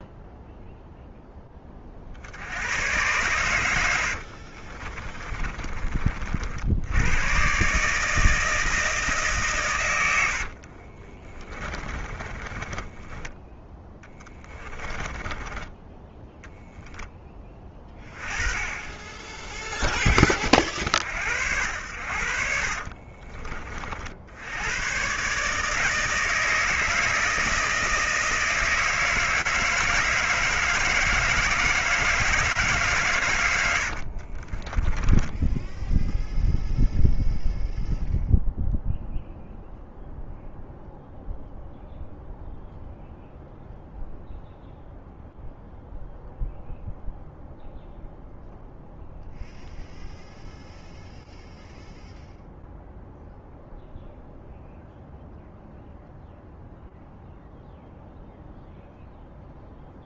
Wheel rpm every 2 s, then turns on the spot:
0, 100, 40, 110, 150, 40, 20, 20, 20, 20, 40, 40, 120, 160, 160, 160, 140, 20, 0, 0, 0, 0, 0, 0, 0, 0, 0, 0, 0, 0.
4-6 10-20 22-24 34-36